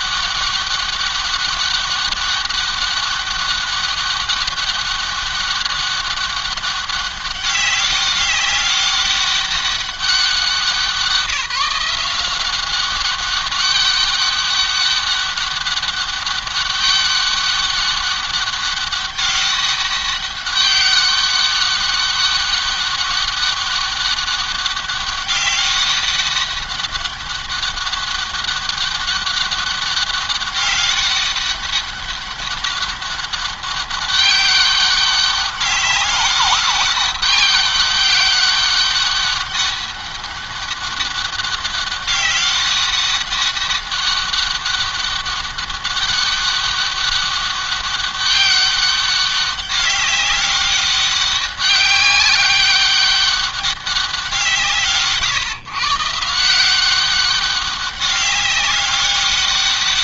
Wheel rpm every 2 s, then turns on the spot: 200, 200, 200, 200, 200, 190, 190, 200, 200, 200, 200, 200, 200, 200, 200, 200, 200, 200, 200, 200, 200, 200, 200, 200, 200, 200, 200, 150, 180, 200.
none